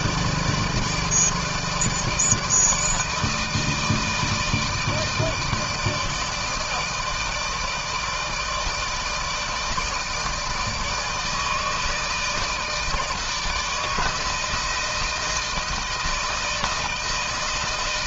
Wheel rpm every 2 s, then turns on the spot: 150, 160, 160, 160, 160, 160, 160, 160, 160.
none